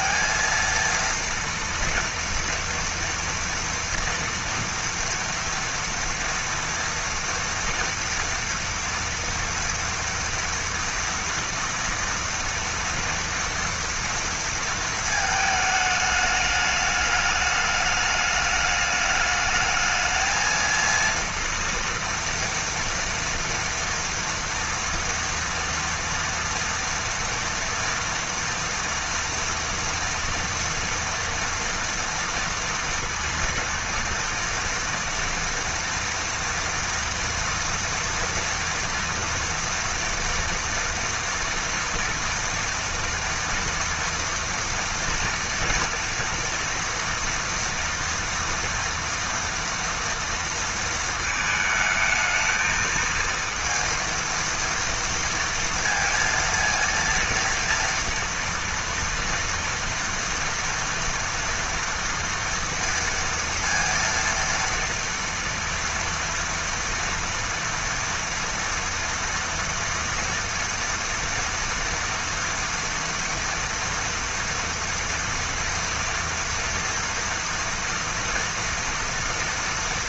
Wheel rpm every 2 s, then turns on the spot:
230, 230, 240, 230, 230, 230, 230, 230, 210, 210, 230, 230, 230, 240, 230, 230, 230, 230, 230, 230, 230, 230, 230, 240, 230, 220, 220, 230, 230, 230, 240, 230, 230, 230, 230, 230, 230, 230, 230, 240.
none